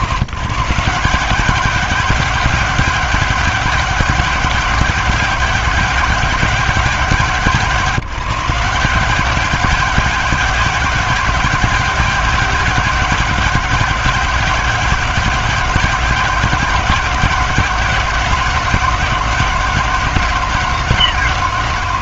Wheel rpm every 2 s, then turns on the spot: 120, 190, 190, 180, 180, 190, 190, 190, 180, 180, 170.
none